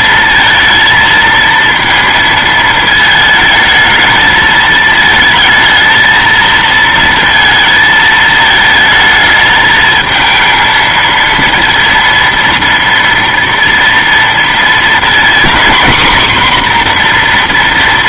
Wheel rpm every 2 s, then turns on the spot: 230, 220, 220, 230, 220, 230, 240, 230, 250.
none